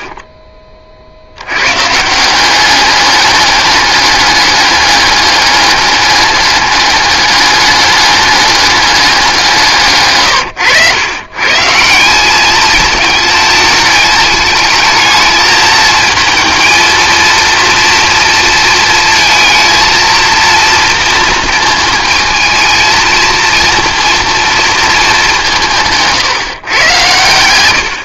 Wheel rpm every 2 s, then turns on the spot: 30, 190, 210, 210, 200, 100, 220, 210, 230, 230, 230, 220, 230, 130.
none